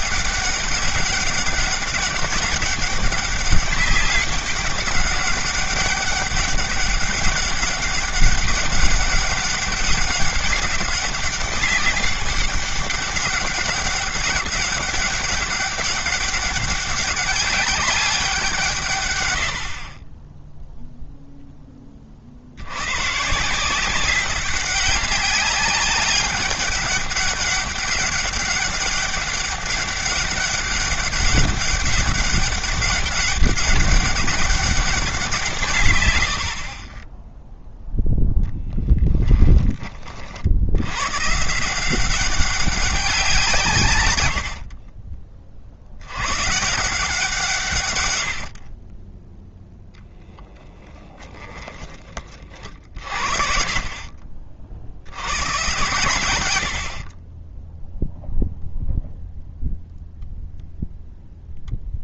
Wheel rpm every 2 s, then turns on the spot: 200, 200, 200, 200, 200, 190, 200, 200, 200, 140, 0, 120, 190, 200, 200, 190, 200, 190, 30, 10, 100, 190, 40, 150, 30, 20, 50, 90, 50, 0, 0.
44-46 50-52